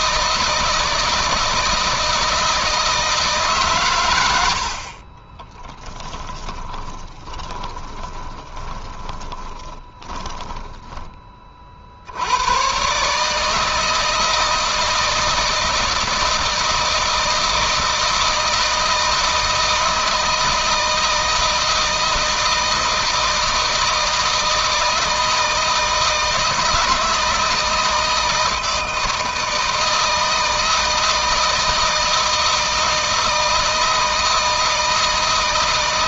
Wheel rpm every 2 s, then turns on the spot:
160, 160, 70, 20, 30, 10, 120, 160, 160, 160, 160, 160, 160, 160, 160, 160, 160, 160.
6-10